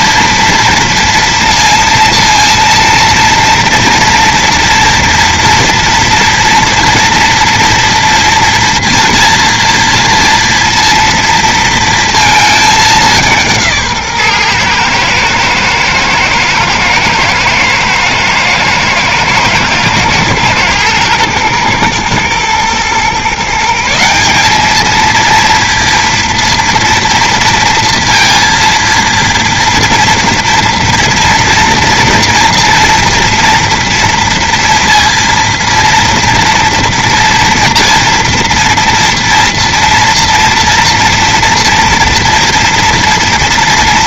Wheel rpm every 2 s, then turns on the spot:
230, 230, 230, 230, 230, 240, 210, 120, 120, 120, 110, 120, 210, 230, 230, 240, 230, 230, 230, 230, 230, 240.
none